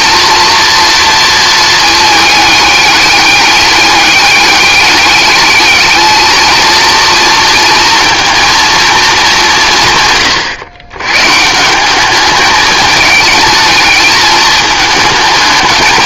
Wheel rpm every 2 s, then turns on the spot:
230, 210, 200, 230, 230, 110, 210, 220.
none